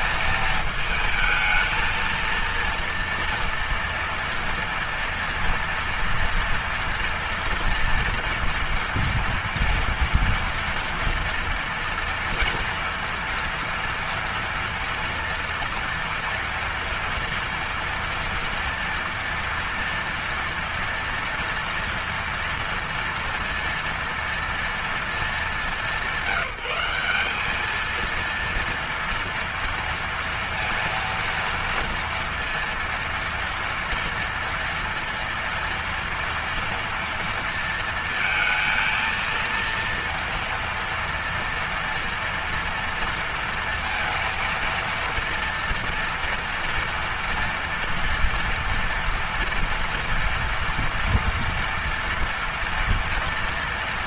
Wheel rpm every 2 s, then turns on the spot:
230, 230, 240, 230, 230, 230, 230, 230, 230, 230, 230, 230, 230, 190, 230, 230, 230, 230, 230, 230, 230, 230, 230, 230, 230, 230, 230.
none